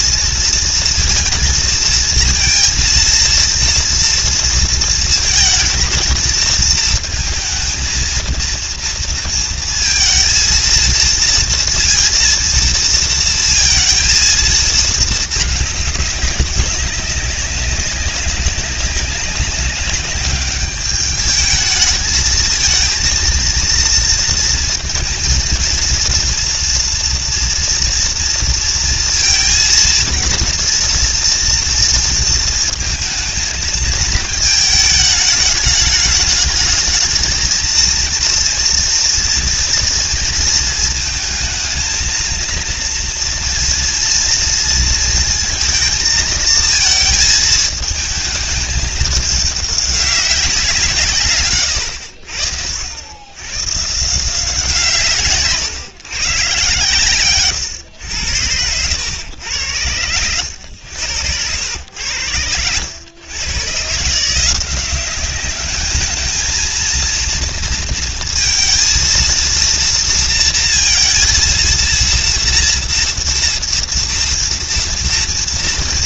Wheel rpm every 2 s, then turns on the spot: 230, 230, 230, 220, 230, 230, 230, 220, 190, 190, 210, 220, 230, 230, 230, 230, 230, 220, 210, 230, 230, 230, 230, 220, 210, 180, 70, 170, 130, 90, 90, 90, 180, 230, 230, 230, 230, 230.
none